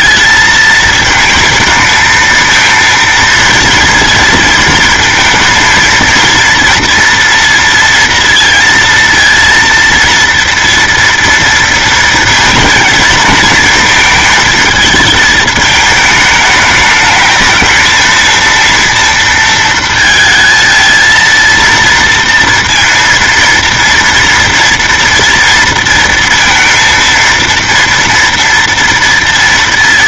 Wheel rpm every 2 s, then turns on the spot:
220, 230, 220, 230, 230, 230, 230, 220, 210, 230, 220, 230, 230, 230, 230.
none